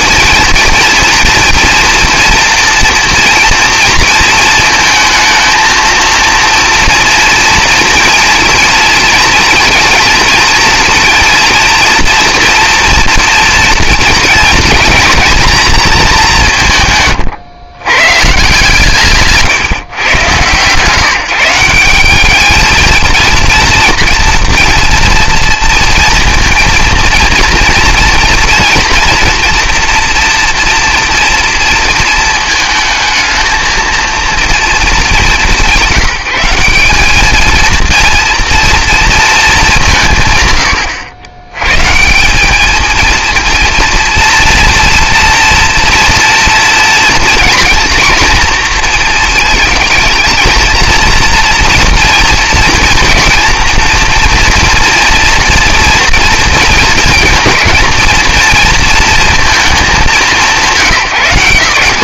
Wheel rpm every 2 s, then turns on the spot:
230, 240, 230, 230, 230, 230, 230, 230, 160, 160, 130, 210, 230, 230, 230, 240, 220, 230, 190, 230, 110, 200, 230, 230, 240, 230, 230, 230, 230, 230, 160.
none